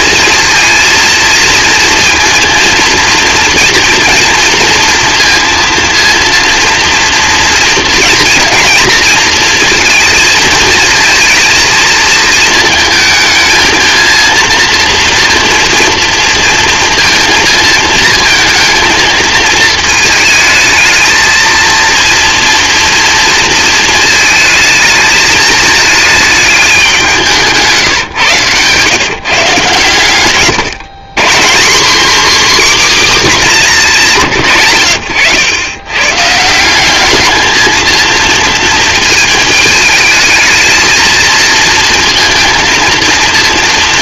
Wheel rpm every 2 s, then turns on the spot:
230, 230, 230, 230, 230, 230, 230, 230, 230, 220, 220, 230, 220, 200, 130, 150, 280, 100, 190, 220, 220, 230.
none